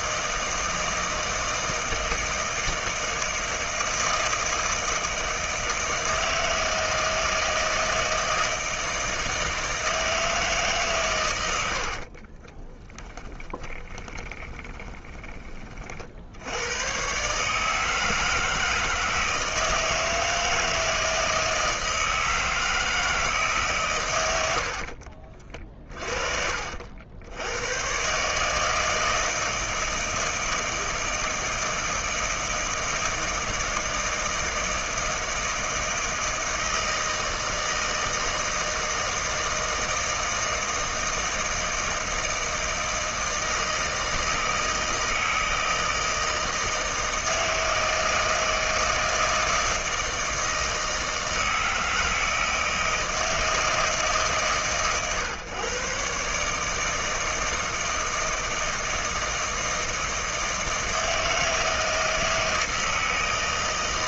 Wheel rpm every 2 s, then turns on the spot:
160, 160, 160, 160, 160, 140, 10, 20, 110, 160, 160, 160, 60, 60, 160, 160, 160, 160, 160, 160, 160, 160, 160, 160, 160, 160, 160, 130, 160, 160, 160, 160.
12-16 24-26